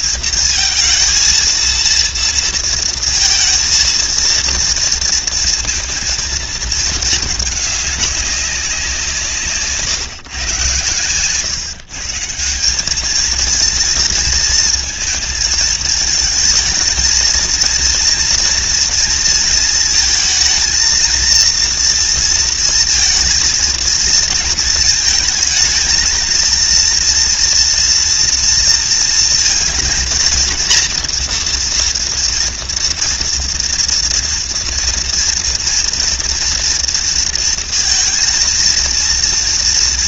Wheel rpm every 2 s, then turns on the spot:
220, 230, 230, 220, 170, 120, 220, 220, 230, 230, 230, 230, 220, 230, 230, 230, 230, 230, 230, 230.
none